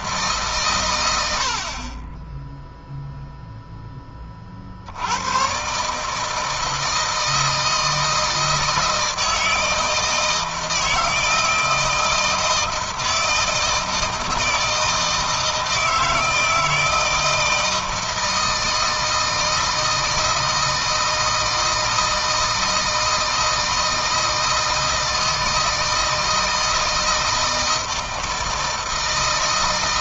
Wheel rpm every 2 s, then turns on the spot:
140, 10, 60, 160, 160, 160, 160, 160, 160, 160, 160, 160, 160, 160, 160.
none